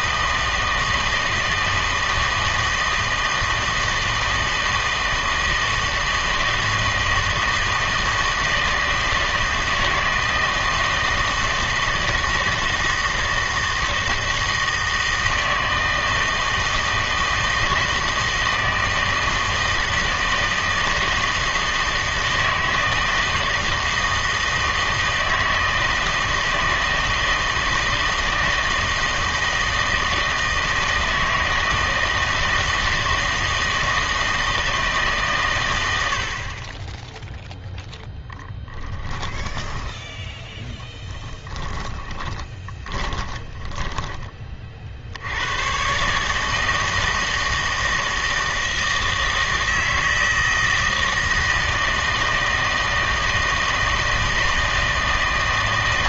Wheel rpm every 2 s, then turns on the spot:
160, 160, 160, 160, 160, 160, 160, 160, 160, 160, 160, 160, 160, 160, 160, 160, 160, 160, 20, 10, 20, 30, 50, 160, 160, 160, 160, 160.
38-44